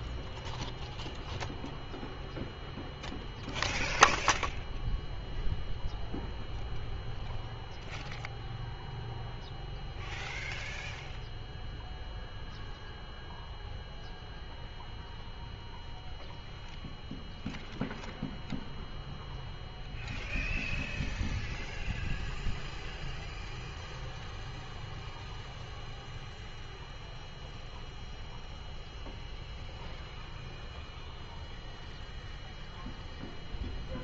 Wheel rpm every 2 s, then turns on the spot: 0, 0, 0, 0, 0, 0, 0, 0, 0, 0, 0, 0, 0, 0, 0, 0, 0.
none